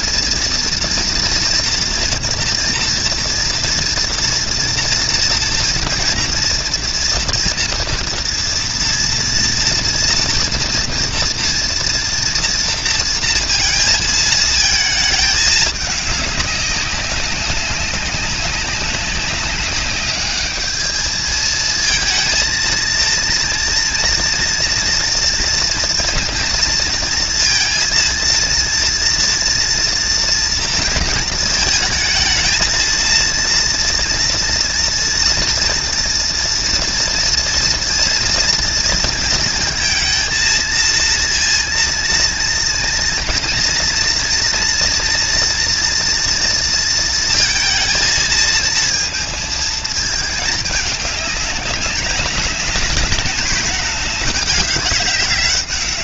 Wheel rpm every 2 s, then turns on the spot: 230, 230, 230, 230, 230, 230, 230, 220, 200, 200, 210, 220, 230, 230, 230, 230, 230, 230, 230, 230, 220, 230, 230, 230, 230, 210, 210, 210.
none